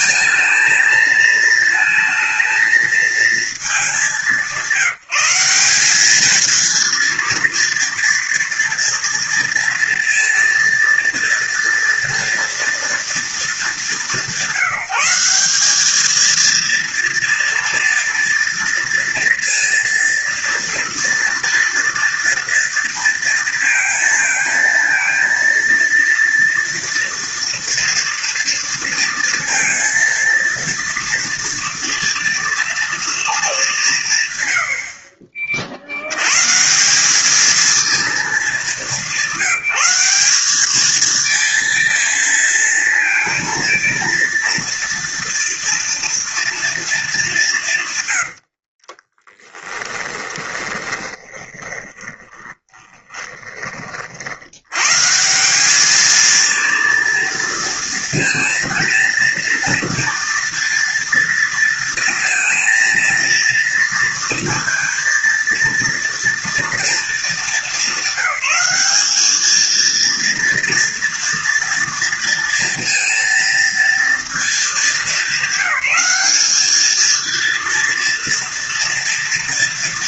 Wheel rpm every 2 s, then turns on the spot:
220, 230, 180, 230, 230, 230, 220, 190, 230, 230, 230, 230, 230, 230, 230, 230, 220, 40, 200, 190, 220, 230, 230, 200, 20, 20, 20, 160, 230, 230, 230, 230, 230, 220, 210, 230, 230, 210, 230, 230.
48-54